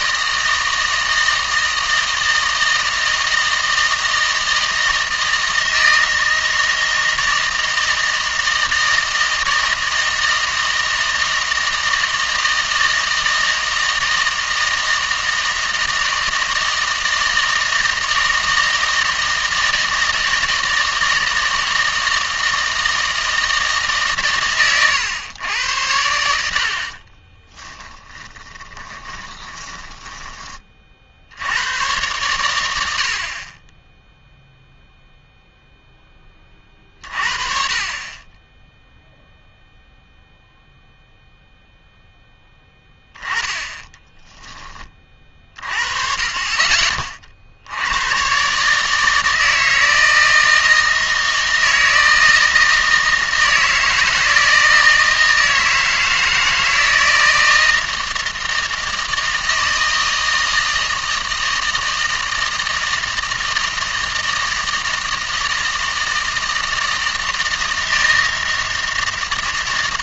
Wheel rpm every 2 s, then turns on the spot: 160, 160, 160, 160, 160, 160, 160, 160, 160, 160, 160, 160, 130, 80, 20, 40, 90, 0, 40, 10, 0, 10, 20, 30, 140, 160, 160, 160, 160, 160, 160, 160, 160, 160, 160.
28-30